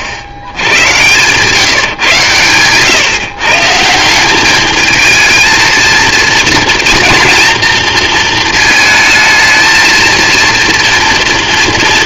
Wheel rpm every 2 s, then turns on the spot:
70, 130, 210, 230, 220, 230.
0-2